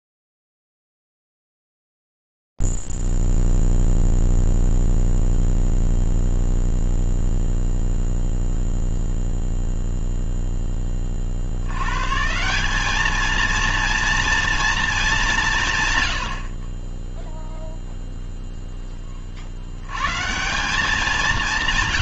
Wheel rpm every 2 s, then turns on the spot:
0, 0, 0, 0, 0, 0, 140, 230, 80, 0, 150.
none